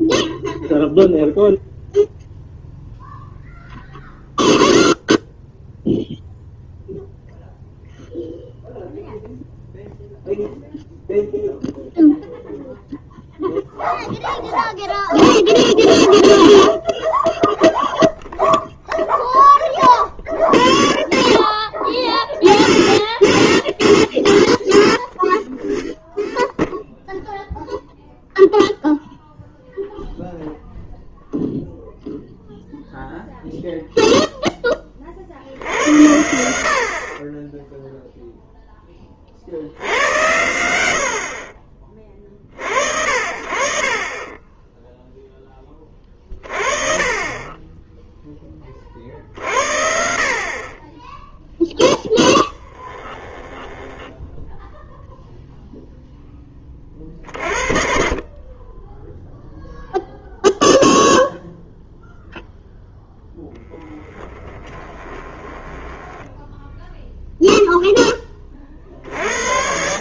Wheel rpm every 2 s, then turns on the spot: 0, 0, 0, 0, 0, 0, 0, 0, 0, 0, 0, 0, 0, 0, 0, 0, 0, 10, 70, 0, 90, 40, 20, 40, 30, 30, 10, 10, 10, 20, 0, 0, 10, 10, 20.
52-54 64-68